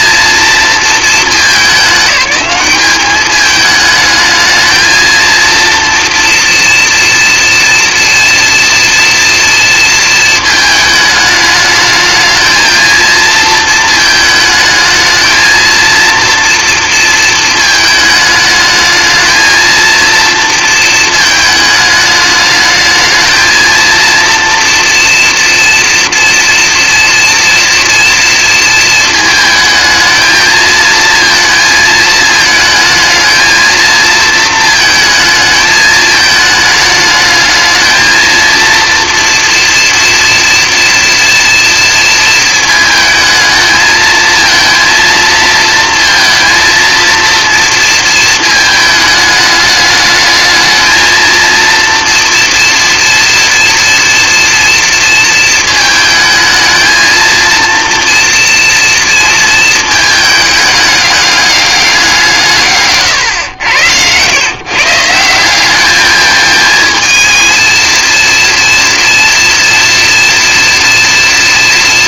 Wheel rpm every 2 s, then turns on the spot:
220, 210, 230, 240, 230, 210, 230, 220, 230, 220, 220, 220, 230, 230, 220, 220, 220, 220, 210, 240, 230, 220, 230, 230, 220, 220, 230, 230, 230, 230, 210, 120, 180, 230, 230, 230.
none